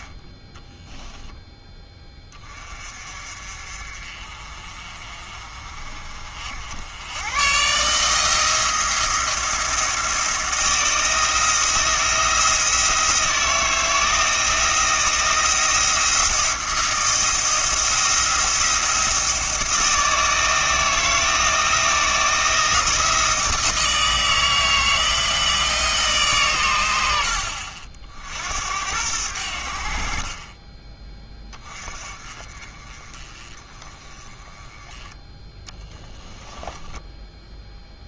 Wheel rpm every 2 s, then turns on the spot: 0, 30, 40, 90, 170, 170, 160, 170, 170, 170, 160, 160, 160, 100, 80, 20, 30, 20, 20.
36-38